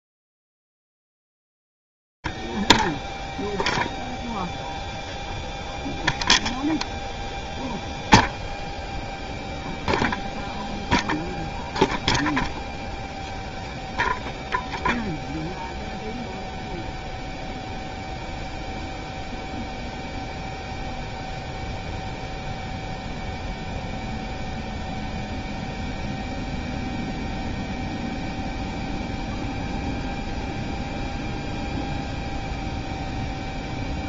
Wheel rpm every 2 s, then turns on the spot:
0, 0, 0, 0, 0, 0, 0, 0, 0, 0, 0, 0, 0, 0, 0, 0, 0.
none